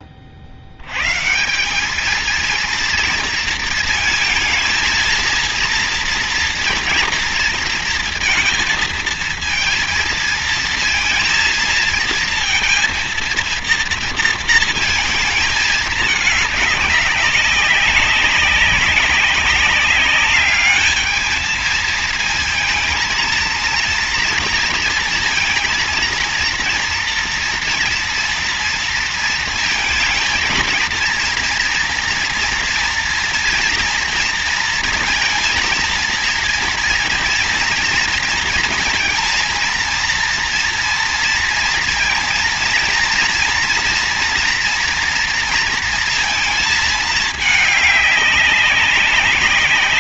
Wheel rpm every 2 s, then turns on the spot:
80, 230, 220, 230, 220, 230, 230, 230, 200, 190, 210, 230, 230, 230, 230, 230, 230, 230, 230, 230, 230, 230, 230, 220, 200.
none